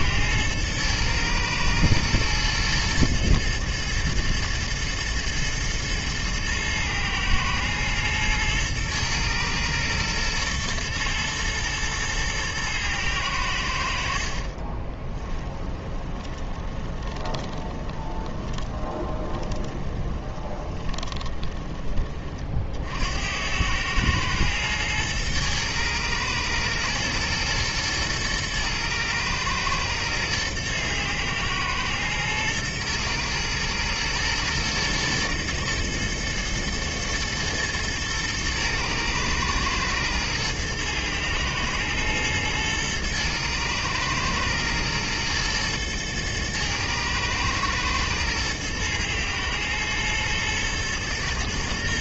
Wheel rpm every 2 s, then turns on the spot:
110, 110, 110, 110, 110, 120, 110, 30, 20, 20, 30, 60, 110, 110, 110, 110, 110, 120, 110, 110, 110, 110, 110, 110, 120, 110.
14-22